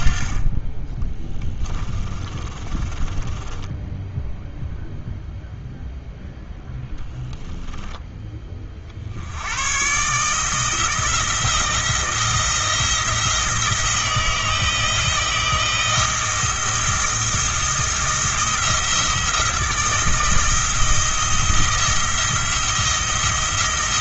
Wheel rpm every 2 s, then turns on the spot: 20, 20, 0, 10, 40, 160, 170, 160, 170, 170, 160, 160.
2-4 6-8